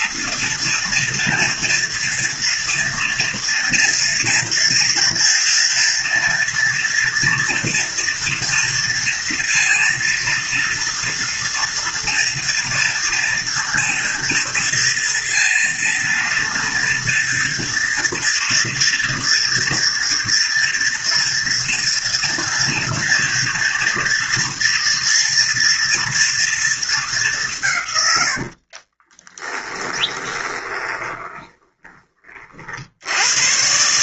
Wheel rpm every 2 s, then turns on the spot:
230, 230, 230, 230, 230, 230, 230, 230, 230, 230, 230, 230, 230, 220, 50, 20, 50.
28-32